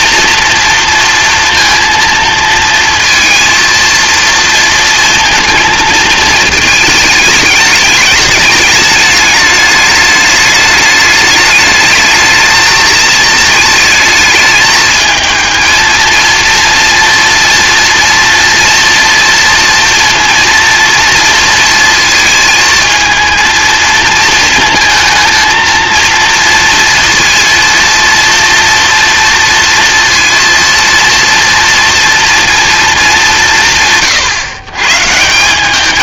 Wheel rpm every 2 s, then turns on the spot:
230, 230, 230, 220, 210, 210, 220, 220, 230, 230, 230, 220, 230, 230, 230, 230, 220, 130.
none